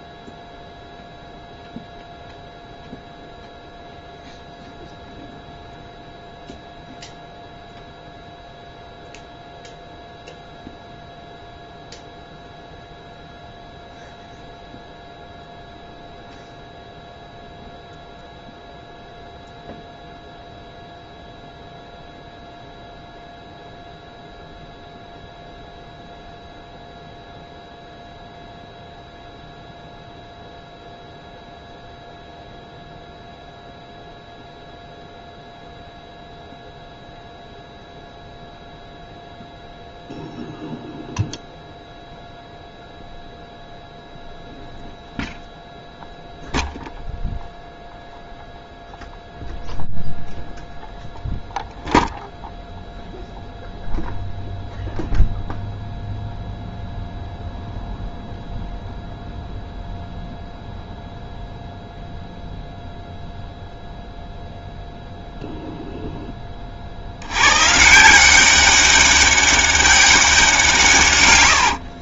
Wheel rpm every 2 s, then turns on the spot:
0, 0, 0, 0, 0, 0, 0, 0, 0, 0, 0, 0, 0, 0, 0, 0, 0, 0, 0, 0, 0, 0, 0, 0, 0, 0, 0, 0, 0, 0, 0, 0, 0, 30, 200, 170.
none